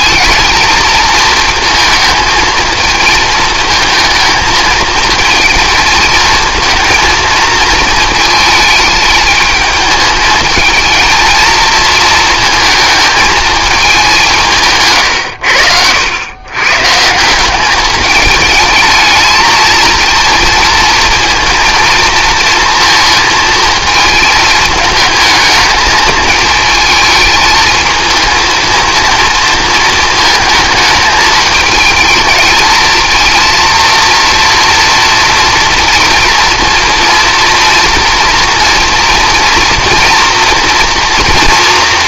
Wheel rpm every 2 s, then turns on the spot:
220, 220, 220, 230, 220, 220, 220, 160, 120, 210, 220, 230, 220, 220, 230, 220, 220, 230, 230, 230, 240.
none